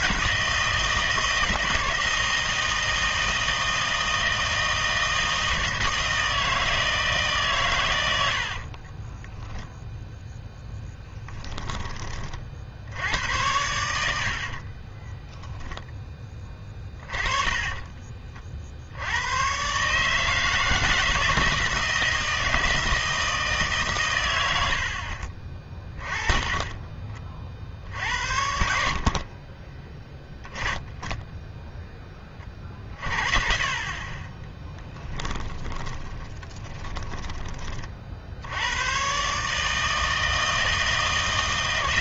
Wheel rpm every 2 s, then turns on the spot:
160, 160, 160, 160, 40, 10, 70, 30, 20, 60, 160, 160, 80, 30, 60, 10, 30, 10, 20, 100, 160.
8-12 14-18 26-28 34-38